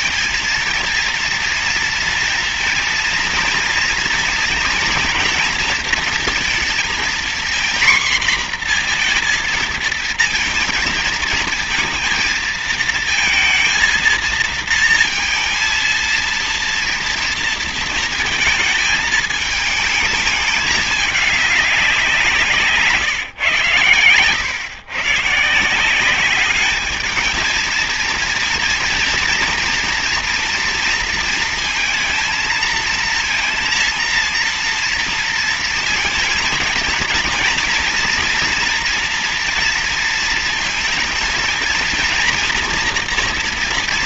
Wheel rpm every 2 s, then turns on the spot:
230, 230, 240, 230, 240, 230, 230, 230, 230, 220, 210, 170, 120, 210, 230, 230, 230, 230, 220, 240, 230, 230.
none